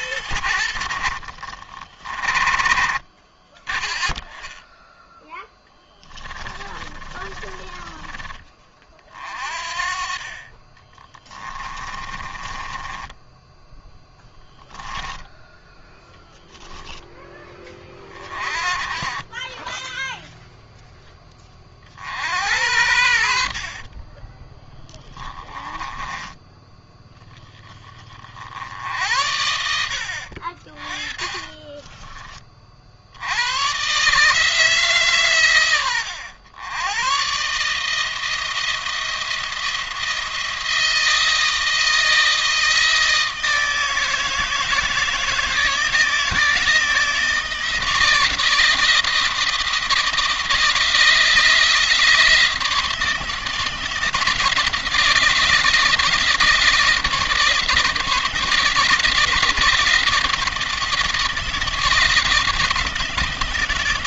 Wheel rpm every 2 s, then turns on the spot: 70, 30, 0, 30, 40, 20, 10, 0, 10, 30, 10, 70, 10, 10, 70, 30, 60, 140, 100, 170, 160, 160, 160, 160, 160, 160, 160, 170, 160, 160, 160, 160.
6-8 10-14 18-20 22-26